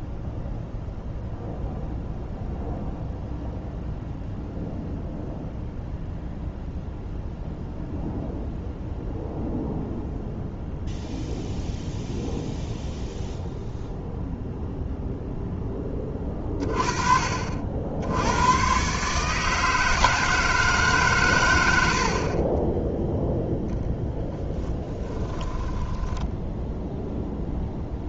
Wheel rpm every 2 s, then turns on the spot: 0, 0, 0, 0, 0, 0, 0, 0, 30, 130, 150, 10, 20, 0.
24-26